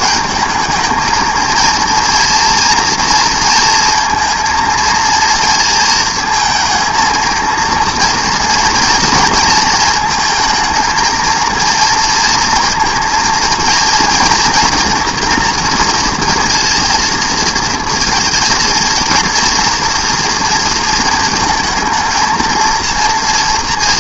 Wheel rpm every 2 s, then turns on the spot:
220, 230, 230, 230, 230, 220, 230, 240, 230, 230, 230, 230.
none